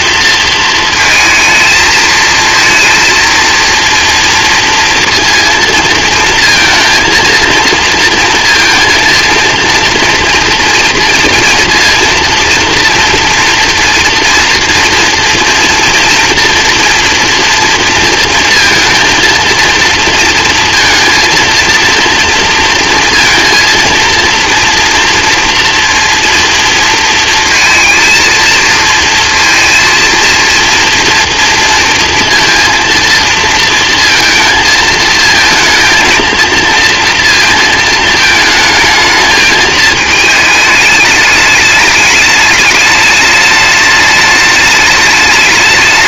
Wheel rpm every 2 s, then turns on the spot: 220, 230, 230, 230, 230, 230, 230, 230, 240, 230, 230, 230, 230, 230, 230, 230, 230, 230, 230, 220, 210, 210, 210.
none